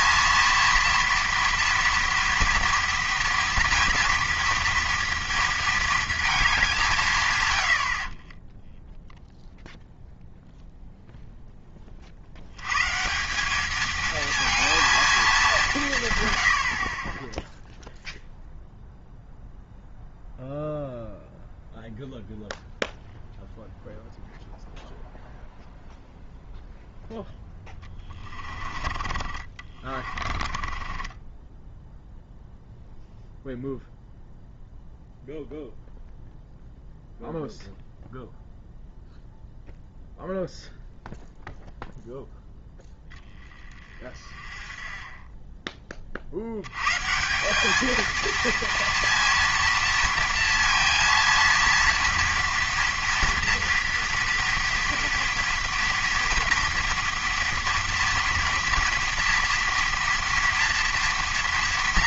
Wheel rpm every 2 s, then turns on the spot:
230, 230, 230, 190, 10, 0, 110, 220, 50, 0, 0, 0, 0, 0, 30, 30, 0, 0, 0, 0, 0, 0, 20, 100, 230, 230, 230, 230, 230, 240, 240.
28-32